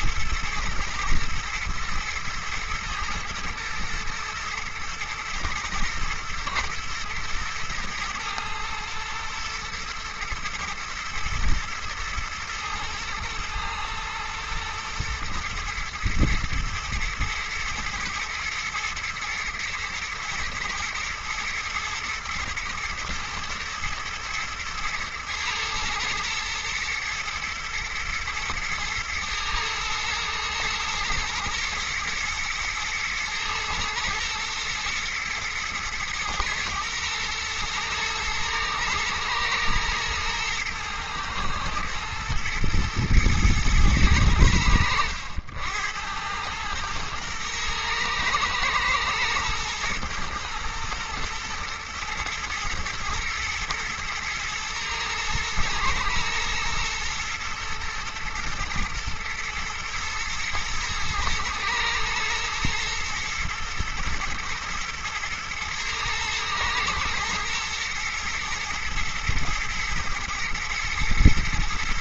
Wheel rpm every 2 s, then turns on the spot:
120, 110, 110, 110, 110, 110, 110, 110, 120, 120, 120, 110, 110, 110, 110, 110, 110, 120, 120, 110, 110, 110, 90, 110, 120, 120, 110, 120, 110, 120, 110, 110, 110, 120, 110, 110.
none